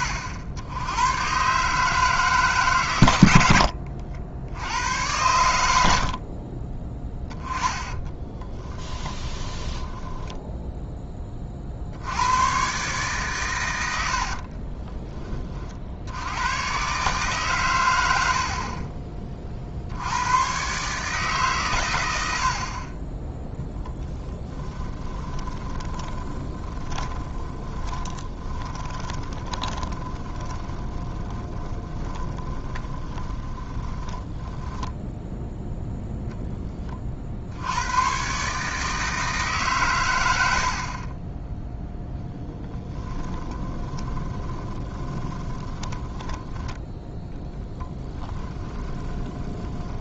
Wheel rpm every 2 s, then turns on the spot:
90, 130, 90, 30, 20, 10, 130, 30, 120, 40, 130, 30, 10, 20, 30, 30, 20, 10, 20, 150, 60, 20, 20, 10, 20.
6-10 14-16 24-36 42-46 48-50